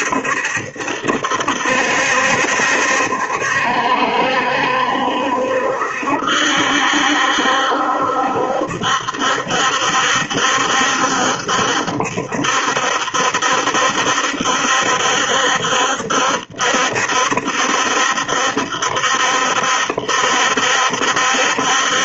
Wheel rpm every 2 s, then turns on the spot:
70, 70, 70, 70, 70, 70, 70, 70, 70, 70, 70.
none